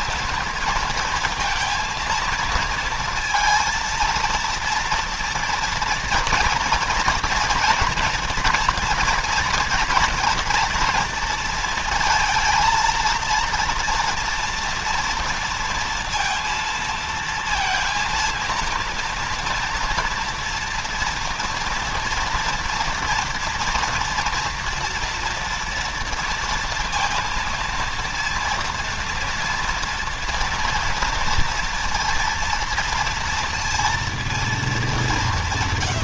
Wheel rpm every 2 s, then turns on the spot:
230, 230, 230, 240, 230, 230, 230, 230, 230, 230, 230, 230, 230, 230, 230, 230, 230, 220.
none